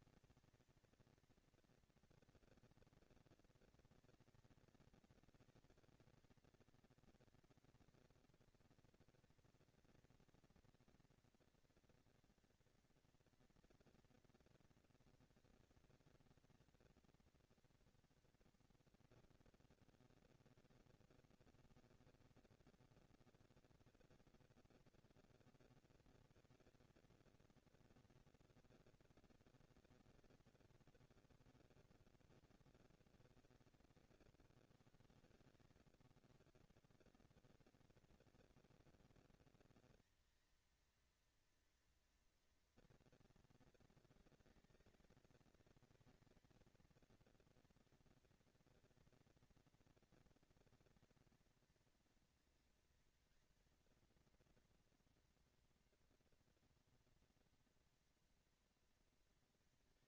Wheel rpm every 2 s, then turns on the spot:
230, 240, 230, 230, 230, 230, 230, 230, 240, 240, 230, 230, 230, 230, 230, 220, 180, 150, 130, 230, 220, 230, 220, 230, 230, 230, 220, 230, 230, 230.
none